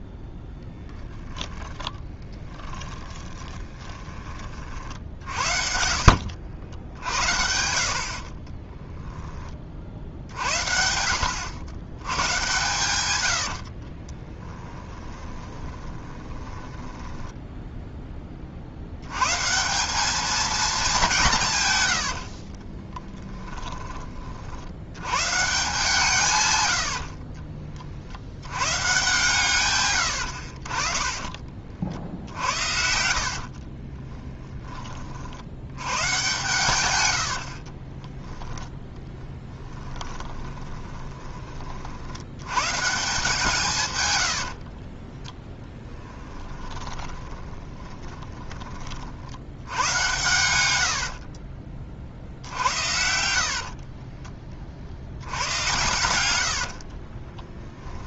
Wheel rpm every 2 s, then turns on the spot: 10, 10, 50, 70, 10, 60, 110, 10, 10, 70, 200, 20, 80, 90, 120, 40, 60, 20, 100, 10, 20, 140, 40, 20, 40, 80, 70, 50, 60.
0-4 8-10 14-18 22-24 32-34 40-42 44-48 52-54 56-58